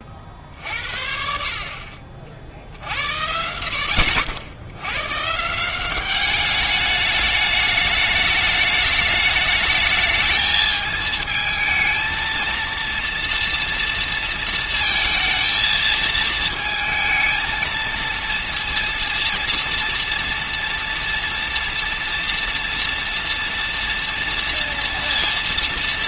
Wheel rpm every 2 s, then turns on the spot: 60, 70, 100, 210, 210, 220, 230, 230, 220, 230, 230, 230, 230.
none